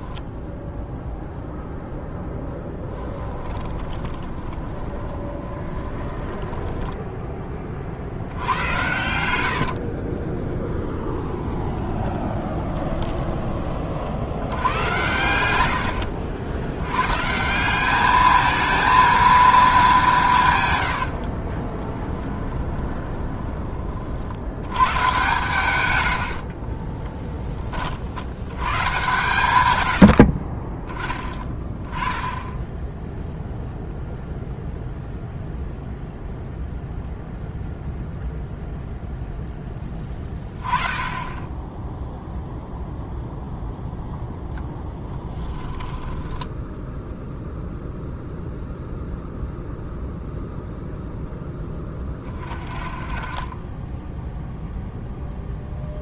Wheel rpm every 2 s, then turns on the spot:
10, 10, 10, 10, 100, 10, 20, 90, 100, 220, 120, 20, 100, 20, 110, 30, 10, 0, 0, 0, 10, 0, 0, 10, 0, 0, 30, 0.
2-14 20-24 26-28 30-32 46-48